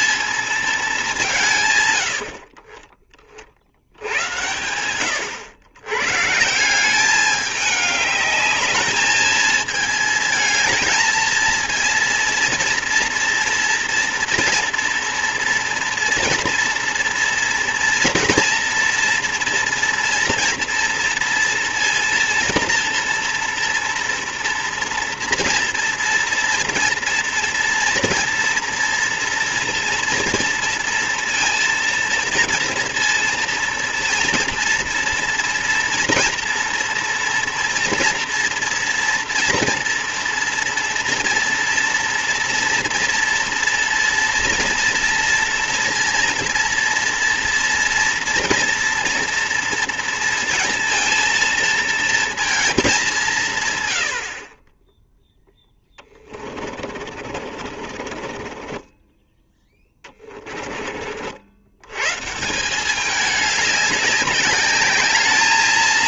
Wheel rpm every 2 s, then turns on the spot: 220, 30, 100, 180, 210, 220, 230, 230, 230, 240, 230, 230, 240, 240, 230, 230, 230, 230, 230, 230, 240, 230, 230, 230, 230, 230, 220, 30, 40, 20, 30, 180, 200.
54-60